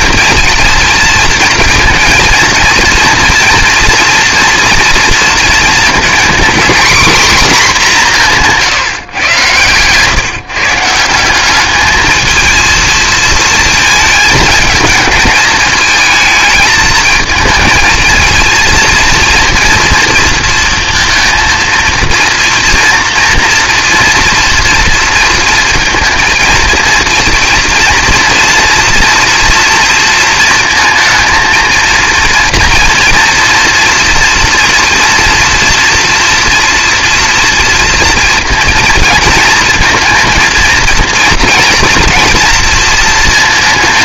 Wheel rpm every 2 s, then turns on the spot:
230, 240, 230, 250, 160, 150, 220, 210, 220, 220, 230, 230, 230, 230, 230, 230, 230, 240, 230, 230, 230, 230.
none